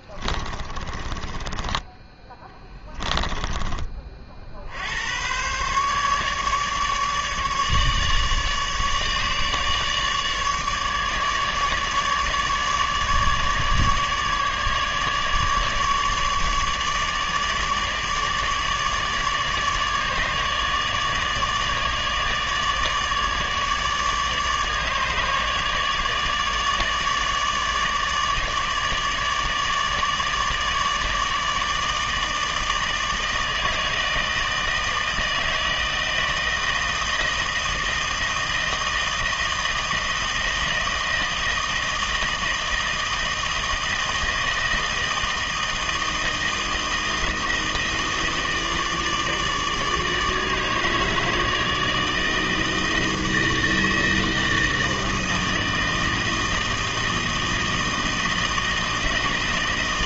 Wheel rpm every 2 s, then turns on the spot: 30, 10, 70, 150, 150, 150, 150, 150, 150, 150, 150, 150, 150, 150, 150, 160, 160, 160, 160, 160, 160, 160, 160, 160, 160, 150, 160, 160, 160, 160.
0-4